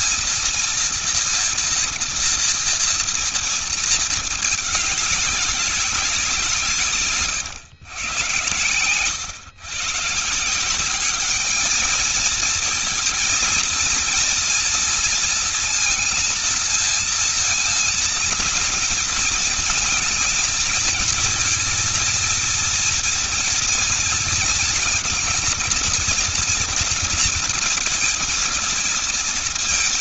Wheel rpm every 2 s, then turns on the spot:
230, 230, 210, 150, 110, 190, 230, 230, 230, 230, 220, 230, 230, 230, 230.
6-8